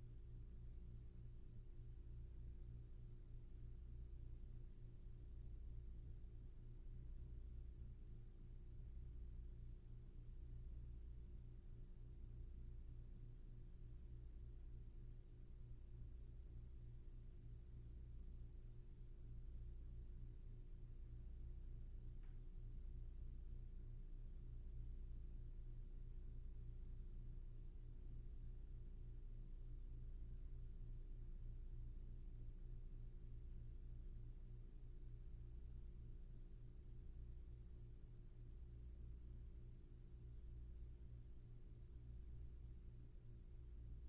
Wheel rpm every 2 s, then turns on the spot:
0, 0, 0, 0, 0, 0, 0, 0, 0, 0, 0, 0, 0, 0, 0, 0, 0, 0, 0, 0, 0, 0.
none